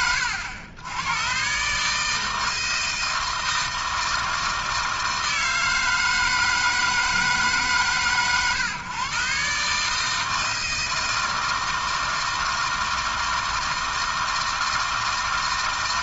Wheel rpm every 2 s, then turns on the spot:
110, 160, 160, 160, 120, 160, 160, 160.
none